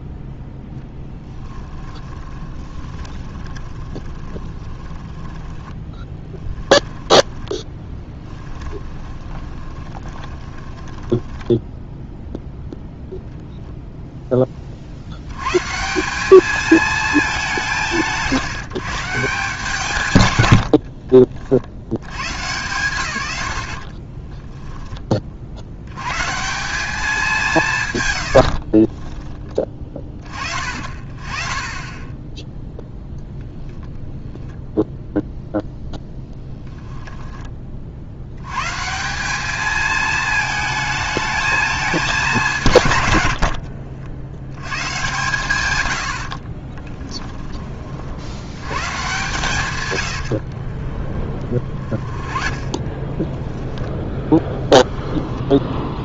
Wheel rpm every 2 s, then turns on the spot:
10, 20, 30, 10, 20, 10, 0, 50, 220, 150, 70, 100, 10, 190, 40, 40, 0, 0, 0, 150, 220, 130, 110, 20, 110, 30, 20, 10.
0-12 20-22 28-30 46-48 50-56